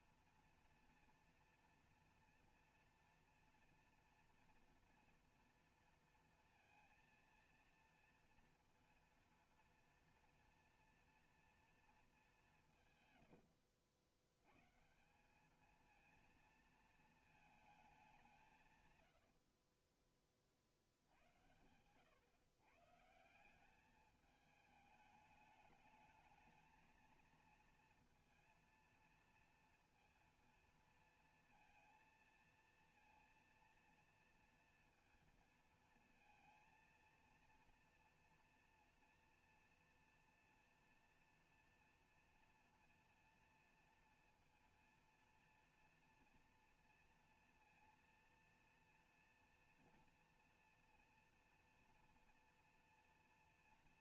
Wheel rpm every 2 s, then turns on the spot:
230, 230, 230, 230, 230, 230, 190, 120, 230, 180, 40, 130, 210, 220, 230, 230, 230, 230, 230, 230, 230, 230, 230, 230, 230, 230, 230.
none